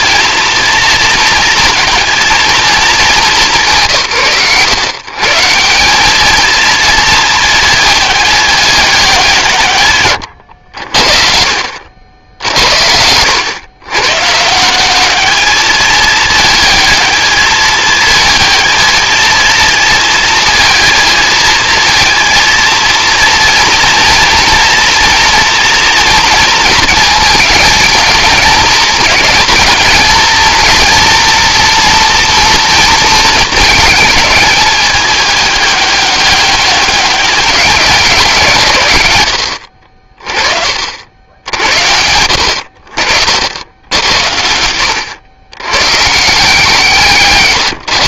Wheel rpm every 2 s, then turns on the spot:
230, 220, 120, 220, 210, 80, 70, 160, 220, 220, 230, 230, 240, 230, 210, 230, 230, 220, 200, 140, 50, 70, 70, 160.
44-46